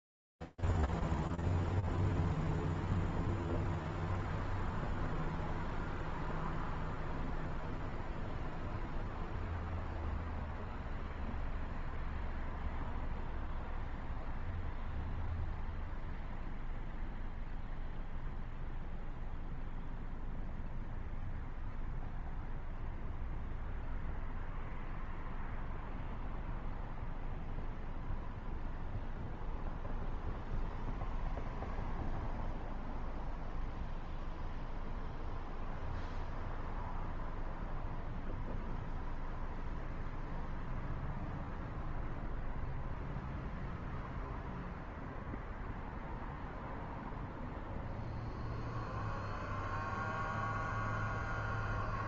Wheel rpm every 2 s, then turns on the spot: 0, 0, 0, 0, 0, 0, 0, 0, 0, 0, 0, 0, 0, 0, 0, 0, 0, 0, 0, 0, 0, 0, 0, 0, 0, 0.
none